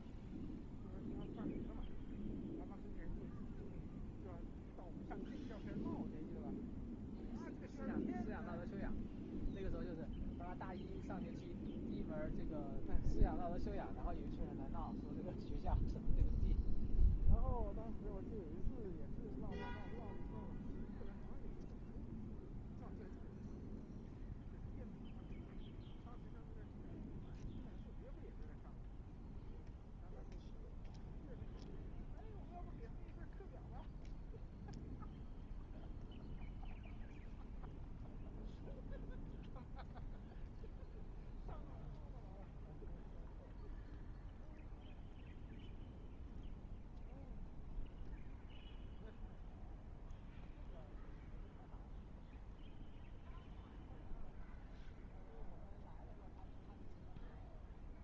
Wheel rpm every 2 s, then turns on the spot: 0, 0, 0, 0, 0, 0, 0, 0, 0, 0, 0, 0, 0, 0, 0, 0, 0, 0, 0, 0, 0, 0, 0, 0, 0, 0, 0, 0, 0.
none